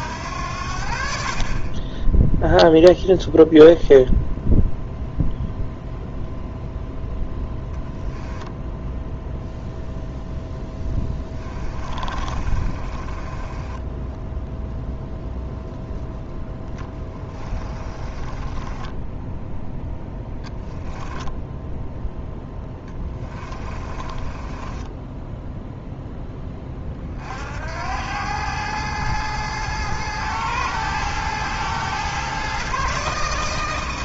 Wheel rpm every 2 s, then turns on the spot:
70, 0, 0, 0, 0, 10, 30, 0, 10, 20, 10, 10, 20, 20, 110, 110, 130.
10-14 16-26